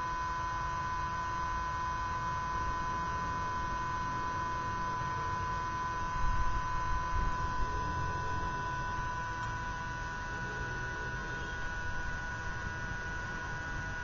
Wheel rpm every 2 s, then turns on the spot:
0, 0, 0, 0, 0, 0, 0.
none